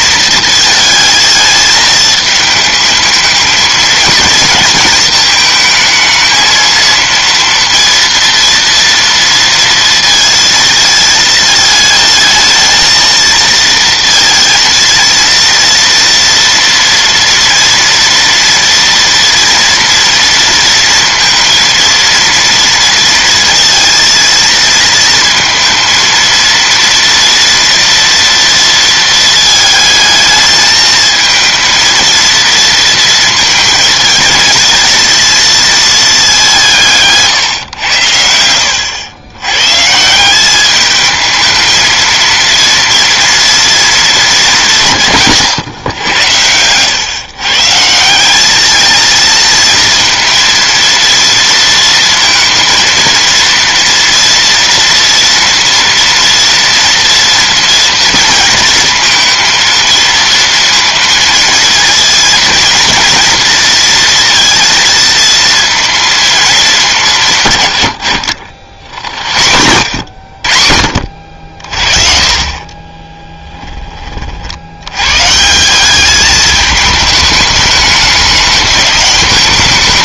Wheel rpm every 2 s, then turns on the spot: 220, 220, 220, 230, 230, 220, 220, 230, 230, 230, 230, 230, 230, 230, 230, 220, 230, 230, 170, 80, 210, 230, 190, 100, 210, 230, 230, 230, 230, 230, 230, 230, 230, 200, 70, 60, 20, 80, 210, 200.
72-74